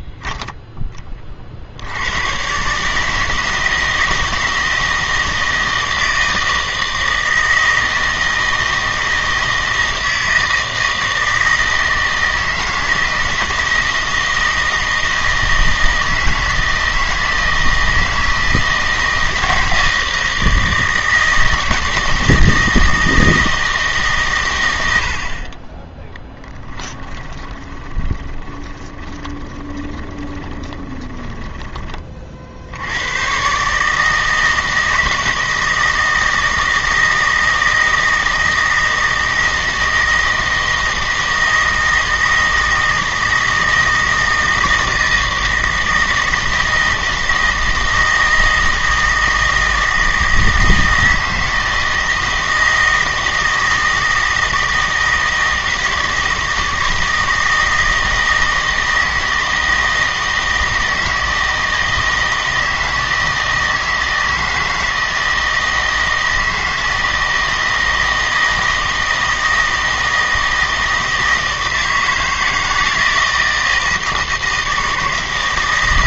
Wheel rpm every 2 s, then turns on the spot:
10, 140, 160, 160, 160, 160, 160, 160, 160, 160, 160, 160, 100, 10, 20, 20, 70, 160, 160, 160, 160, 160, 160, 160, 160, 160, 160, 160, 160, 160, 160, 160, 160, 160, 160, 160, 160, 160.
26-32